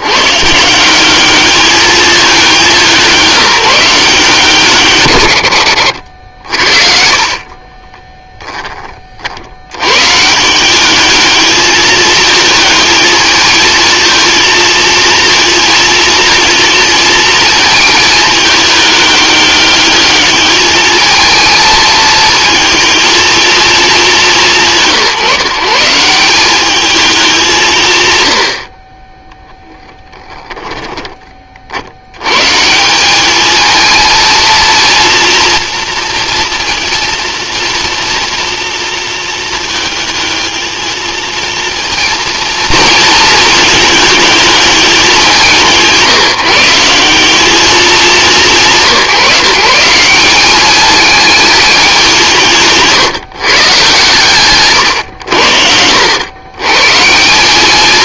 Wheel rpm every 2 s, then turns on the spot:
180, 180, 130, 40, 30, 200, 220, 230, 220, 210, 220, 220, 160, 210, 30, 10, 190, 230, 230, 230, 220, 230, 200, 180, 160, 210, 140, 110, 150.
54-56